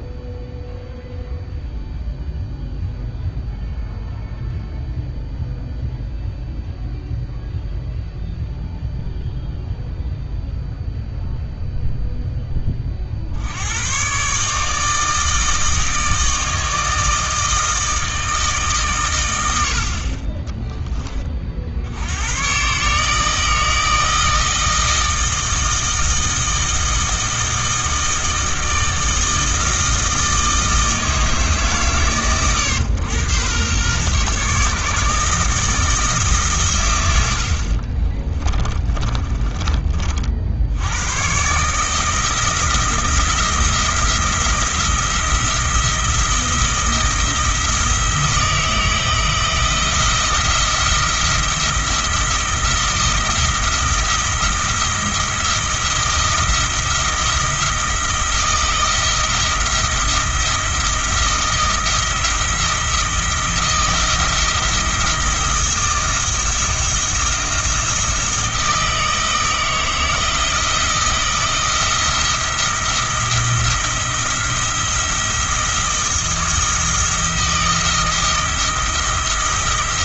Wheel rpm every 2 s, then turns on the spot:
0, 0, 0, 0, 0, 0, 30, 150, 160, 130, 10, 140, 160, 160, 160, 160, 110, 150, 120, 20, 90, 170, 170, 170, 160, 170, 170, 170, 170, 170, 170, 170, 170, 160, 160, 160, 170, 170, 170, 170.
38-40